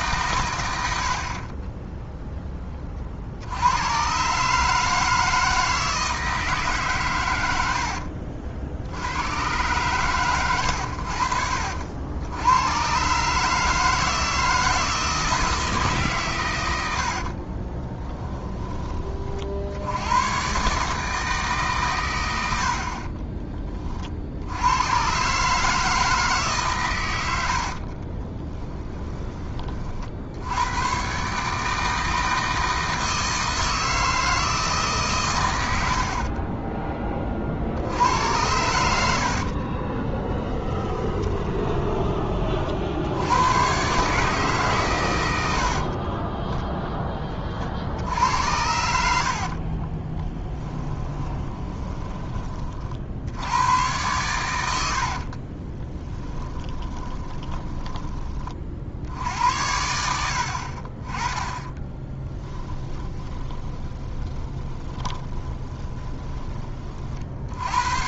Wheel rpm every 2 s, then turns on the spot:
90, 20, 150, 140, 60, 90, 120, 160, 90, 20, 150, 50, 110, 130, 20, 120, 160, 140, 20, 90, 20, 60, 120, 10, 70, 10, 50, 90, 20, 50, 40, 10, 30, 40.
16-18 28-30 40-42 50-52 54-58 62-66